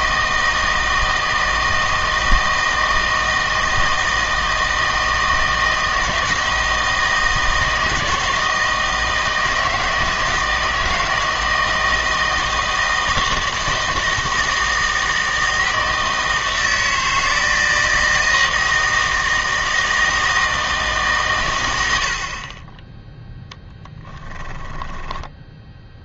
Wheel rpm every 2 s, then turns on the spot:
160, 160, 160, 160, 160, 160, 160, 160, 160, 160, 160, 30, 10.
24-26